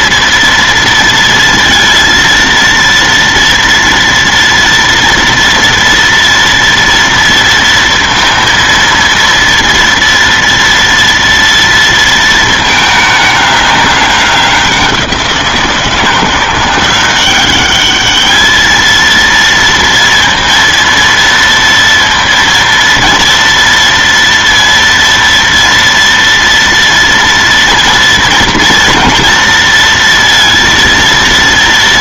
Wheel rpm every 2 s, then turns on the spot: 230, 230, 230, 230, 230, 230, 220, 190, 180, 220, 230, 230, 230, 230, 230, 230.
none